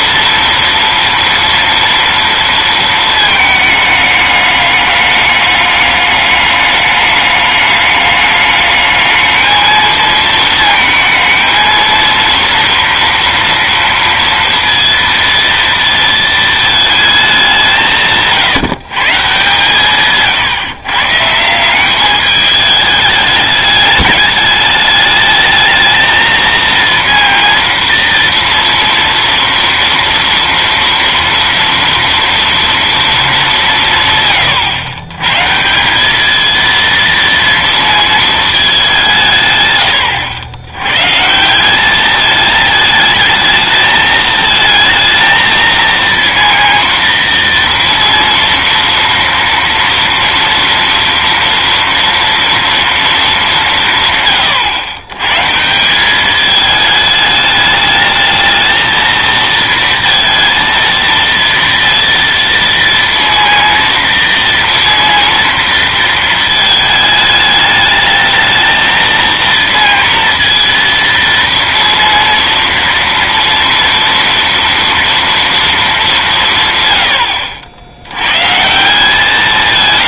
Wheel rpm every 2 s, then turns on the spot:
230, 220, 210, 210, 210, 220, 230, 230, 220, 160, 140, 210, 210, 230, 230, 230, 230, 110, 230, 190, 120, 220, 220, 230, 230, 230, 230, 120, 210, 220, 230, 230, 230, 220, 230, 230, 230, 240, 130, 160.
none